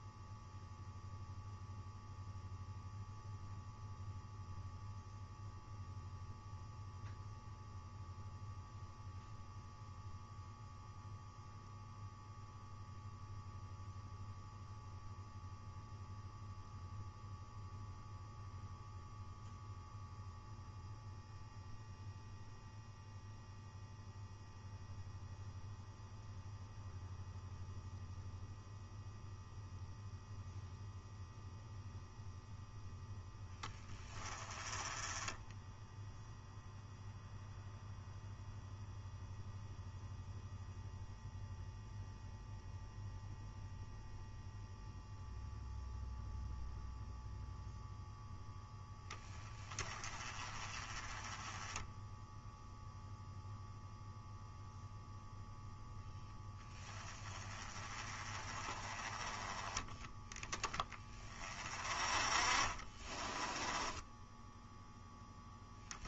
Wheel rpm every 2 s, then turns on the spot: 0, 0, 0, 0, 0, 0, 0, 0, 0, 0, 0, 0, 0, 0, 0, 0, 0, 20, 0, 0, 0, 0, 0, 0, 10, 20, 0, 0, 10, 20, 20, 30, 0.
62-64